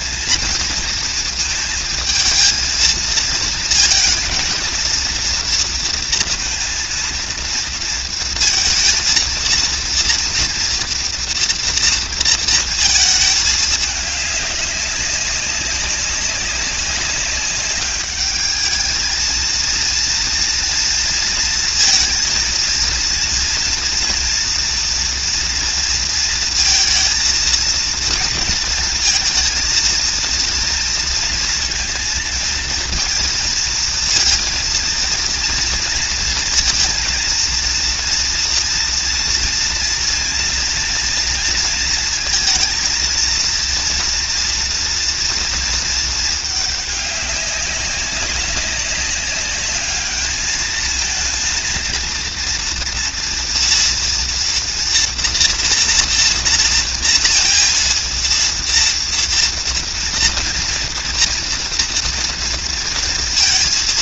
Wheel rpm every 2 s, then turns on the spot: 230, 220, 230, 230, 230, 230, 230, 200, 190, 210, 230, 230, 230, 230, 230, 230, 230, 230, 230, 230, 240, 230, 230, 210, 200, 220, 230, 230, 230, 230, 230, 230.
none